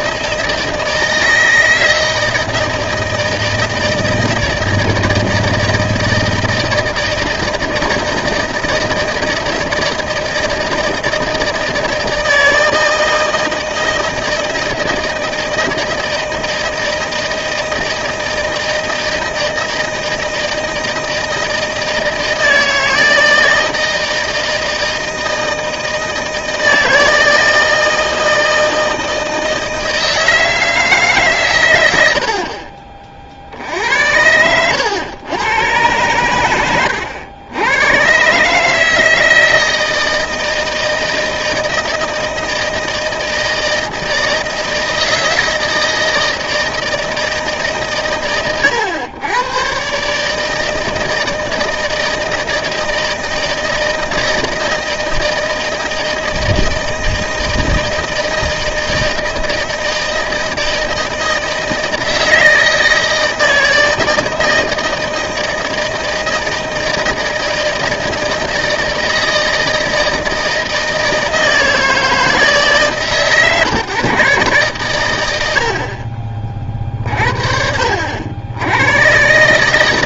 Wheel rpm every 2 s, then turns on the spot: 160, 160, 160, 160, 160, 170, 160, 160, 160, 160, 160, 160, 160, 160, 160, 160, 40, 90, 100, 150, 160, 160, 160, 160, 110, 160, 160, 160, 160, 160, 160, 160, 160, 160, 160, 160, 150, 130, 40, 80.
none